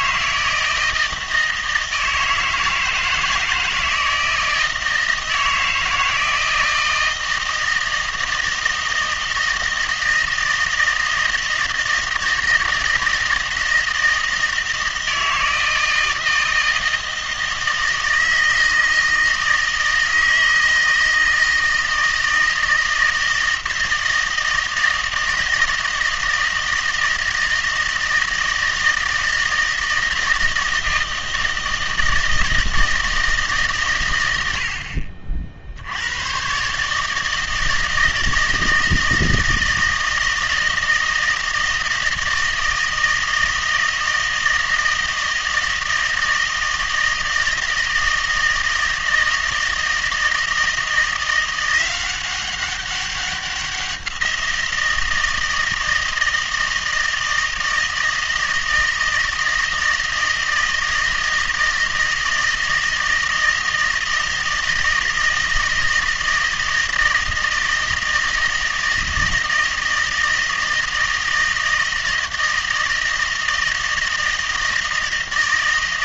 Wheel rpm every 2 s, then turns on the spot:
160, 170, 160, 160, 160, 160, 160, 160, 160, 160, 160, 160, 160, 160, 160, 160, 160, 60, 130, 160, 160, 160, 160, 160, 160, 160, 190, 170, 160, 160, 160, 160, 160, 160, 160, 160, 170, 160.
none